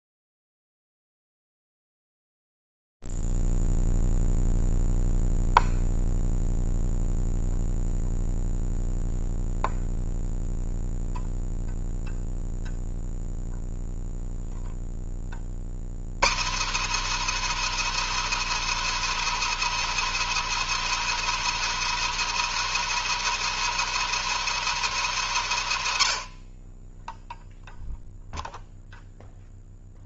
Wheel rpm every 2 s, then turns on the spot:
0, 0, 0, 0, 0, 0, 0, 0, 190, 340, 340, 340, 330, 50, 0.
none